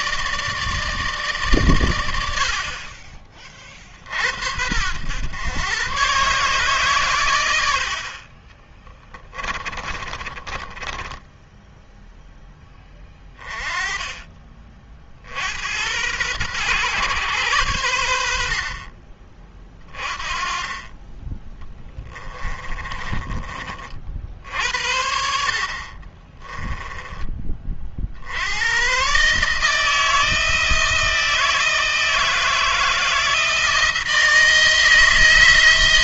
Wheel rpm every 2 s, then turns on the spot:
150, 40, 90, 120, 10, 20, 10, 50, 120, 40, 20, 20, 60, 20, 120, 160, 160, 160.
8-12 22-24